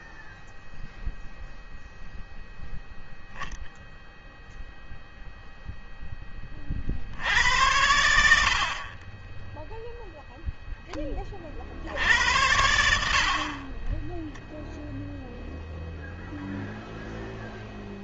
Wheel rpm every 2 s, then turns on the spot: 0, 0, 0, 80, 10, 50, 40, 10, 0.
12-14